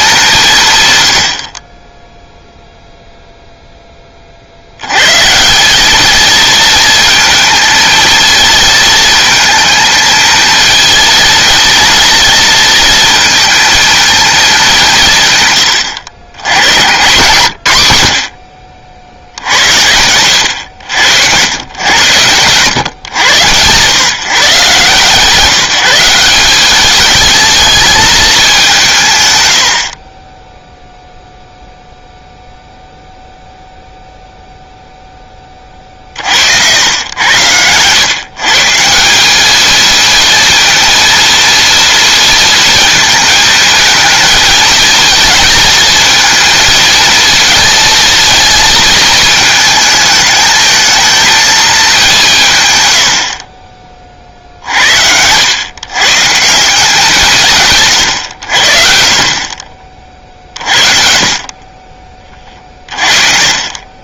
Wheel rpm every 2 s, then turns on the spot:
150, 0, 80, 230, 220, 220, 230, 200, 110, 60, 90, 100, 140, 200, 180, 0, 0, 0, 80, 150, 230, 220, 230, 230, 230, 220, 130, 60, 160, 80, 50, 30.
none